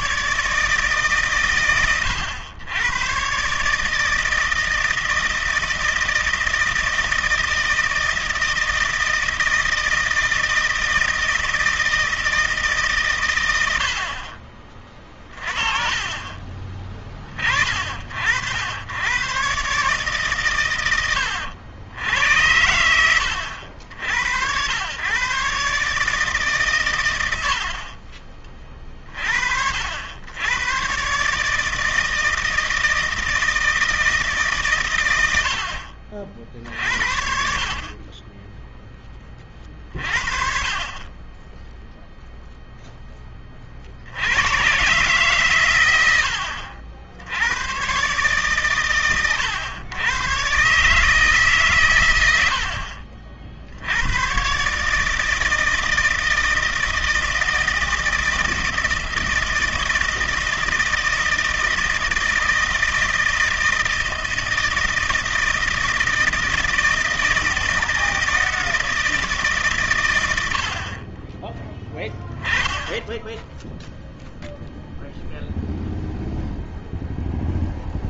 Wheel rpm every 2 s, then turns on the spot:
150, 100, 160, 160, 160, 160, 150, 40, 30, 90, 120, 90, 90, 130, 40, 120, 160, 120, 50, 10, 40, 0, 120, 80, 130, 130, 60, 130, 160, 160, 160, 160, 160, 160, 160, 70, 10, 0, 0.
none